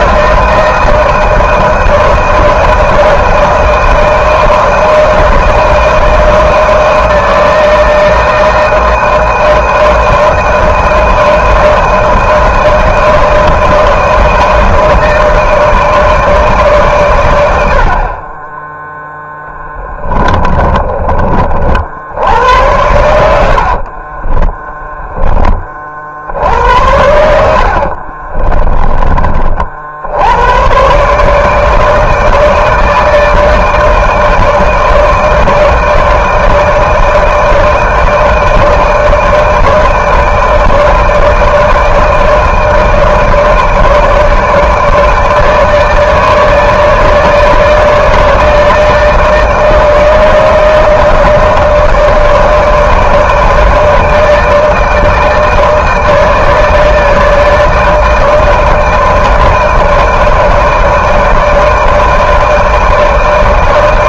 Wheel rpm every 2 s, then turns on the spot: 160, 160, 160, 160, 160, 160, 160, 160, 150, 30, 20, 80, 20, 70, 30, 90, 160, 150, 160, 160, 160, 160, 150, 150, 160, 160, 160, 160, 150, 160, 160, 160.
18-22 28-30